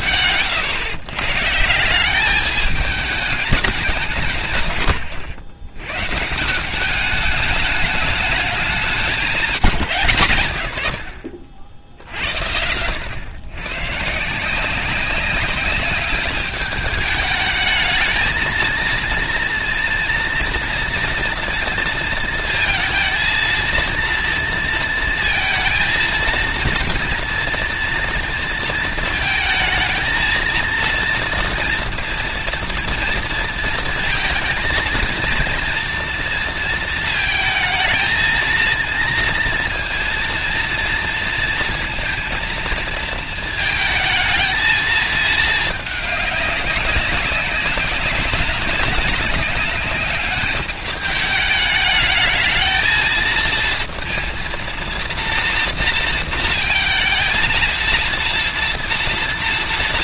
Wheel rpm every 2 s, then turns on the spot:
130, 210, 100, 200, 190, 50, 100, 190, 210, 230, 230, 220, 230, 230, 230, 230, 230, 230, 220, 230, 230, 220, 220, 200, 200, 210, 230, 230, 220, 230.
none